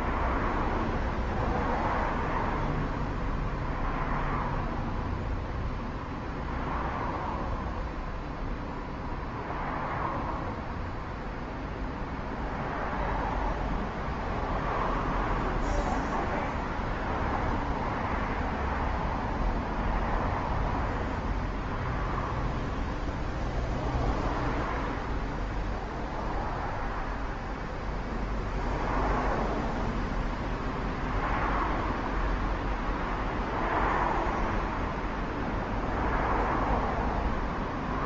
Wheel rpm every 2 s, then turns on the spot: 0, 0, 0, 0, 0, 0, 0, 0, 0, 0, 0, 0, 0, 0, 0, 0, 0, 0, 0.
none